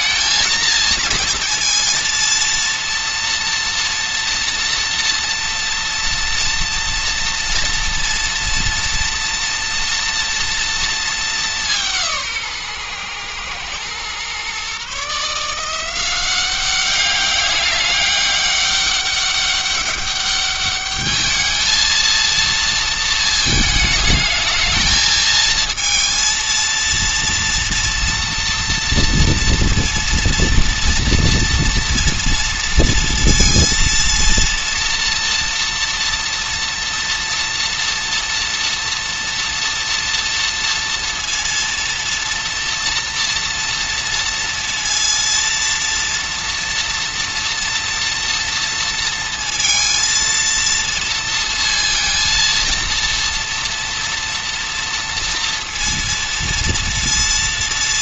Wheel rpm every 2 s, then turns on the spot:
230, 230, 230, 230, 230, 230, 130, 140, 200, 200, 210, 230, 220, 230, 230, 230, 230, 230, 230, 230, 230, 240, 230, 230, 230, 230, 230, 230, 230.
none